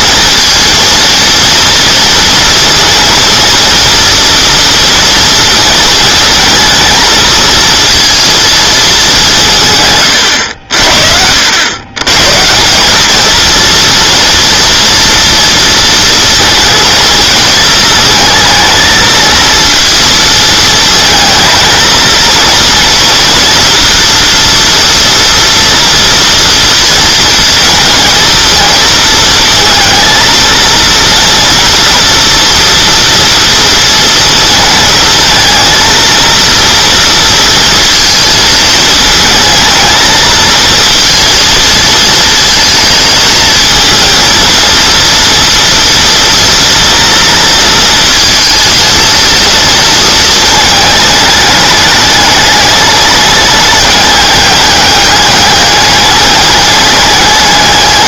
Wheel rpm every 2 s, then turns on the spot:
230, 230, 230, 220, 210, 70, 190, 230, 230, 220, 220, 230, 230, 230, 220, 230, 230, 230, 230, 220, 220, 220, 230, 230, 230, 220, 210, 200, 210.
none